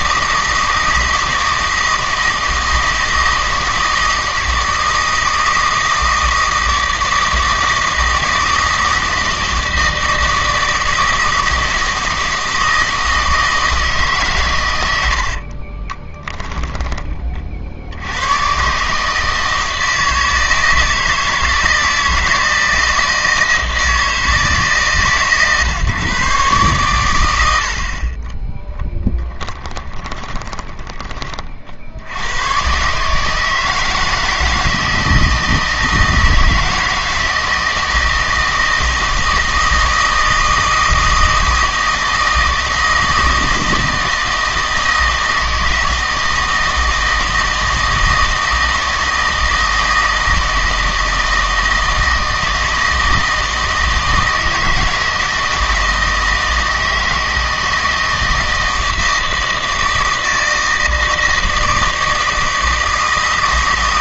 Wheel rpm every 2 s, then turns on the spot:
160, 160, 160, 160, 160, 160, 160, 100, 10, 140, 160, 160, 150, 120, 10, 20, 130, 160, 160, 160, 160, 160, 160, 160, 160, 160, 160, 160, 160, 160, 160, 160.
28-32